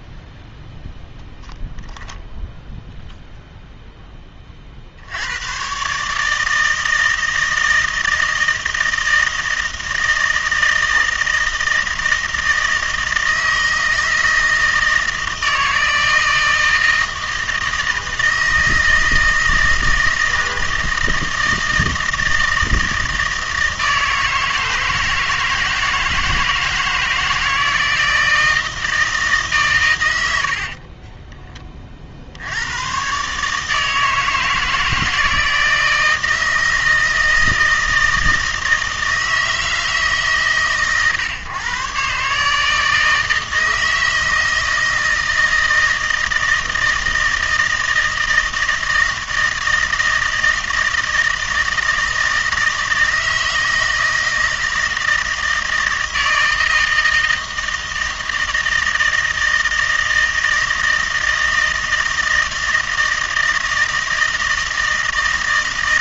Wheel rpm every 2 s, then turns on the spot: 0, 0, 40, 160, 160, 160, 160, 160, 160, 160, 160, 160, 160, 160, 160, 60, 90, 160, 160, 160, 130, 150, 160, 160, 160, 160, 160, 160, 160, 160, 160, 160, 160.
30-32